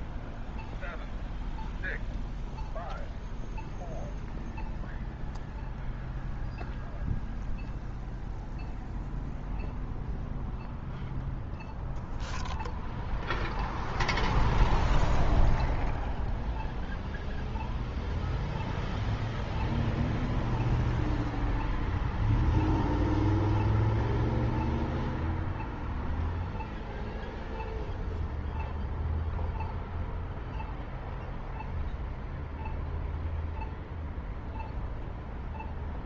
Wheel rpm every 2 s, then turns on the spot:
0, 0, 0, 0, 0, 0, 0, 0, 0, 0, 0, 0, 0, 0, 0, 0, 0, 0.
none